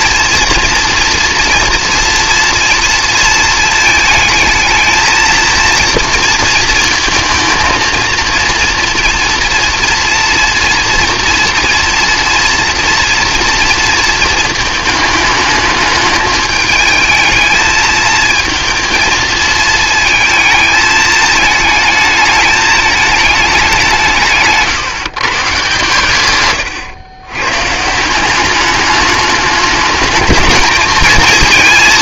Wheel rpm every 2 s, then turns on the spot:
230, 230, 220, 230, 230, 230, 230, 220, 220, 220, 220, 210, 150, 120, 200, 220.
none